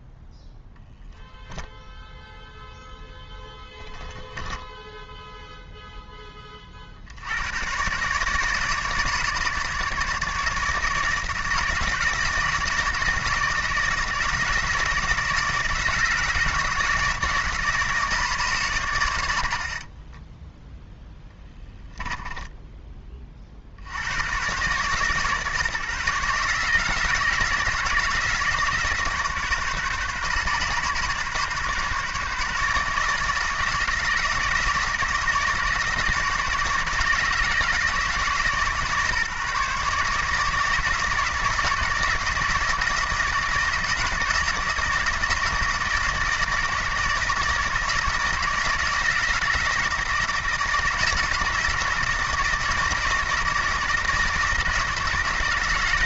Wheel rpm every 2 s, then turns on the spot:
0, 0, 10, 30, 150, 150, 160, 160, 160, 130, 10, 10, 120, 150, 150, 130, 150, 160, 150, 140, 160, 160, 160, 160, 160, 160, 160, 160.
4-6 20-22